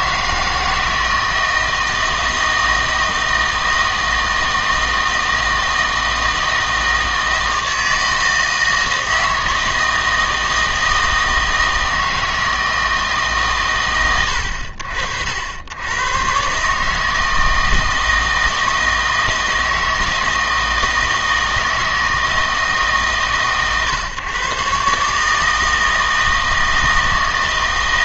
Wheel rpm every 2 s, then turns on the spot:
160, 160, 160, 160, 160, 160, 160, 90, 150, 160, 160, 150, 140, 160.
none